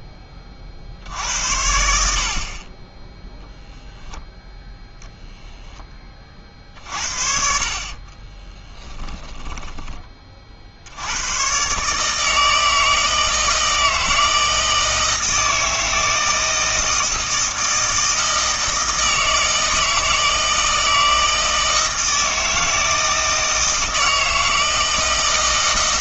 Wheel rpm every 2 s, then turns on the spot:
60, 30, 0, 50, 10, 60, 160, 160, 160, 160, 160, 160, 160.
8-10